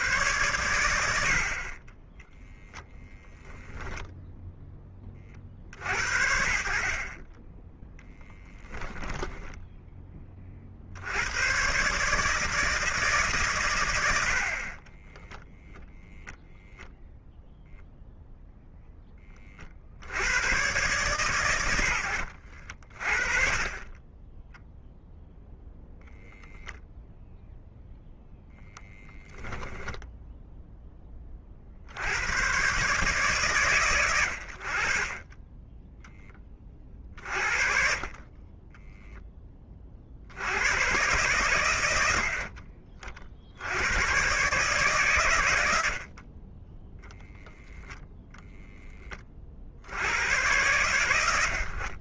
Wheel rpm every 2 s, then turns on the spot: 110, 0, 10, 60, 10, 50, 160, 30, 0, 0, 110, 50, 0, 0, 0, 0, 120, 30, 30, 20, 100, 40, 130, 10, 0, 110.
46-48